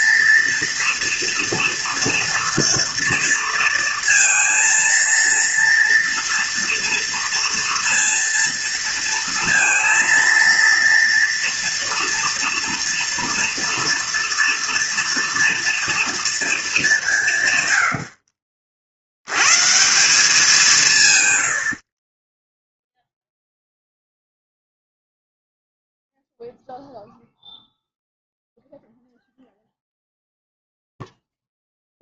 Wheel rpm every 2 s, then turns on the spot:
240, 230, 230, 230, 230, 230, 230, 230, 200, 50, 160, 0, 0, 0, 0, 0.
none